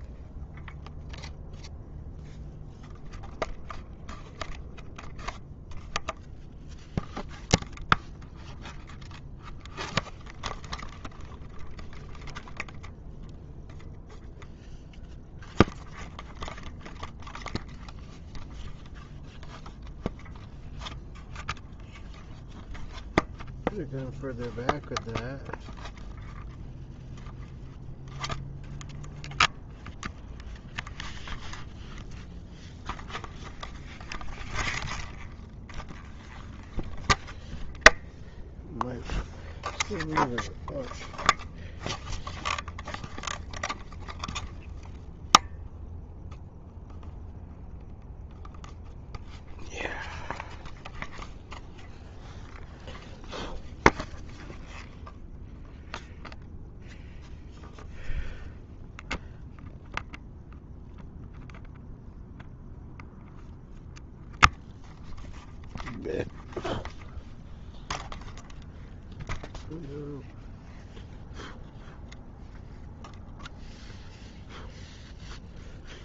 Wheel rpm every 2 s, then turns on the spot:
0, 0, 0, 0, 0, 0, 0, 0, 0, 0, 0, 0, 0, 0, 0, 0, 0, 0, 0, 0, 0, 0, 0, 0, 0, 0, 0, 0, 0, 0, 0, 0, 0, 0, 0, 0, 0, 0.
none